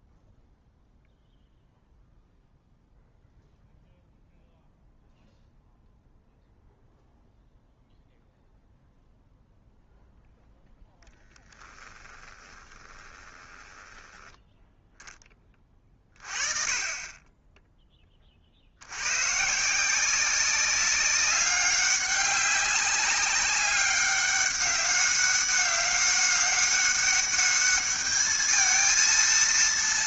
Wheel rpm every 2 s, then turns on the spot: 0, 0, 0, 0, 0, 0, 20, 10, 30, 70, 190, 200, 200, 200, 220.
12-14